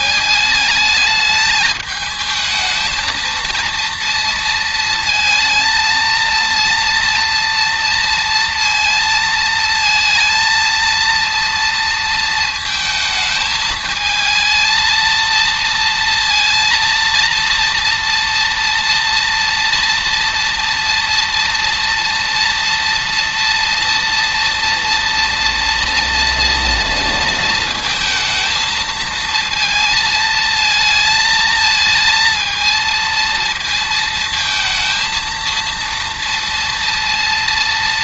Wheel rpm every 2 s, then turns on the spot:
210, 220, 230, 230, 230, 230, 220, 230, 230, 230, 230, 230, 230, 230, 230, 220, 230, 230, 230.
none